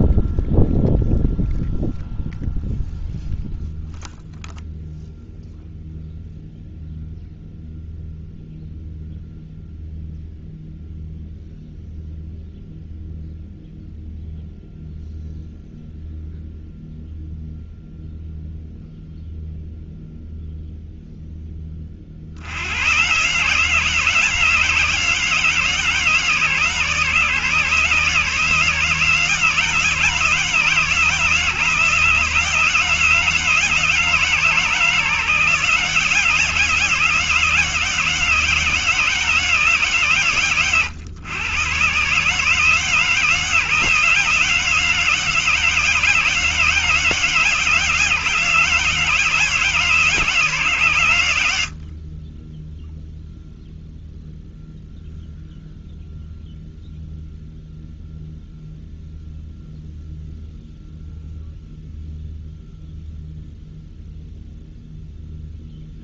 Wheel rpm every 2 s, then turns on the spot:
0, 0, 0, 0, 0, 0, 0, 0, 0, 0, 0, 90, 160, 140, 150, 150, 160, 150, 160, 160, 110, 150, 160, 160, 160, 140, 10, 0, 0, 0, 0, 0, 0.
none